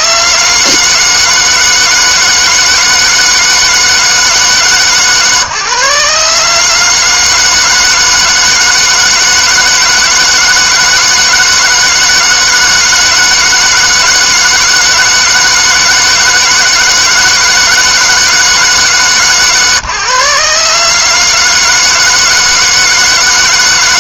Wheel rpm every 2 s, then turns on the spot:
150, 160, 140, 150, 160, 160, 160, 160, 160, 150, 150, 160.
none